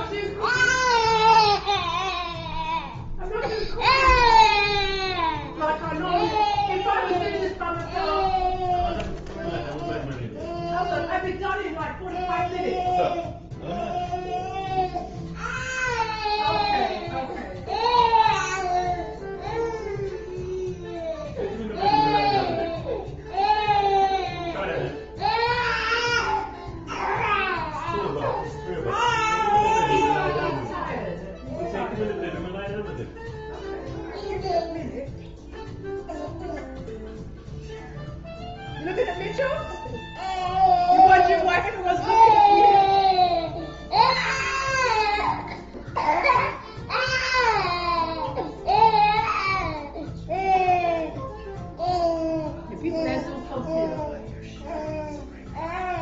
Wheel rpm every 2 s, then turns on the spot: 0, 0, 0, 0, 0, 0, 0, 0, 0, 0, 0, 0, 0, 0, 0, 0, 0, 0, 0, 0, 0, 0, 0, 0, 0, 0, 0, 0.
none